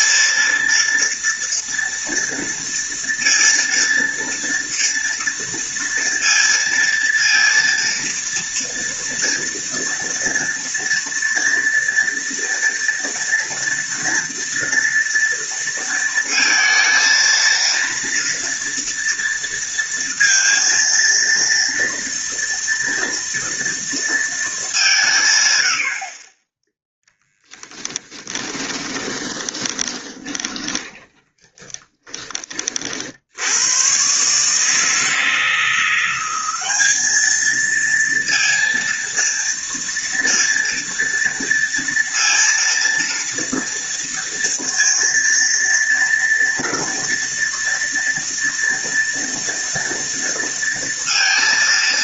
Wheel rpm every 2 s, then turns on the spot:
230, 230, 230, 230, 230, 230, 230, 230, 230, 230, 230, 230, 190, 20, 30, 20, 50, 160, 210, 230, 230, 230, 230, 230, 230, 230.
26-32